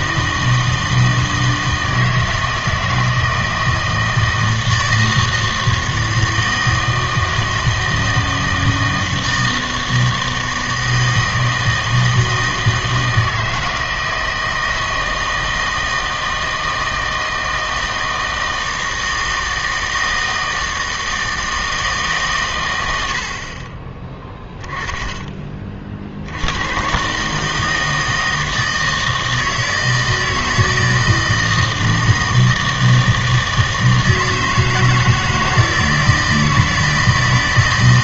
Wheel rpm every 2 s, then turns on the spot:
160, 160, 160, 160, 160, 160, 160, 160, 160, 160, 160, 110, 10, 110, 160, 160, 160, 160, 160.
none